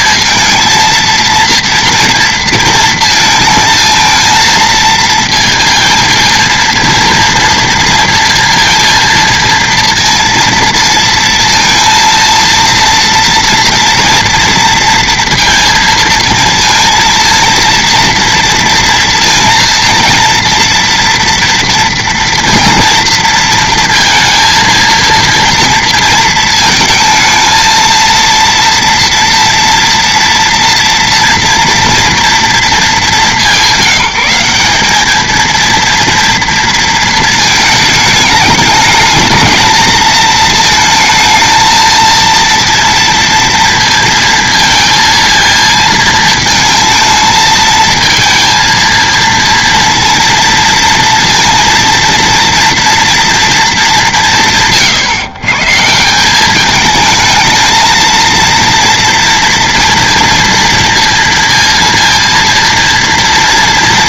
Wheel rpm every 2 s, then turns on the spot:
230, 230, 230, 230, 230, 230, 230, 230, 230, 230, 230, 230, 230, 220, 230, 230, 220, 200, 230, 220, 220, 230, 230, 220, 230, 230, 230, 120, 210, 230, 230, 230.
none